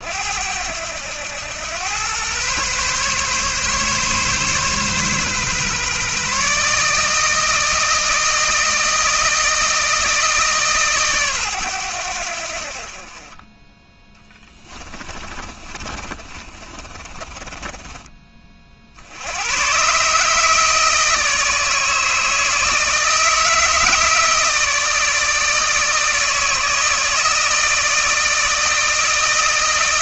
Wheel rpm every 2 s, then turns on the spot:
90, 130, 140, 160, 160, 140, 40, 30, 30, 70, 160, 160, 160, 160, 160.
14-18